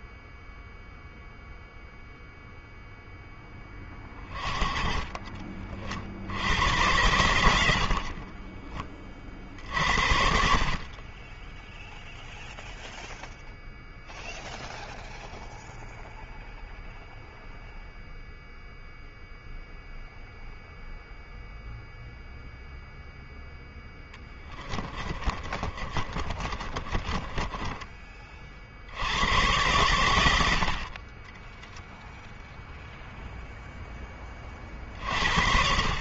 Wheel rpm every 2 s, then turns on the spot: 0, 0, 30, 90, 30, 30, 0, 0, 0, 0, 0, 0, 30, 30, 80, 40, 0, 60.
24-28